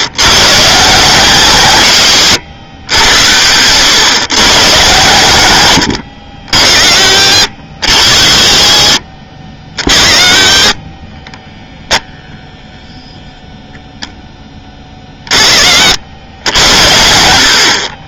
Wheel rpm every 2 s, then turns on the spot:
150, 120, 120, 60, 50, 40, 0, 20, 80.
none